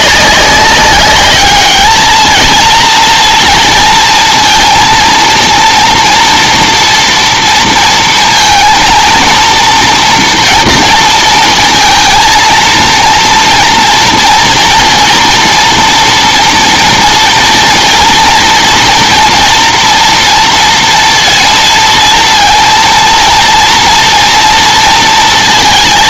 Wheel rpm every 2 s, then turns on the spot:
200, 230, 230, 230, 230, 230, 230, 240, 230, 230, 230, 230, 230.
none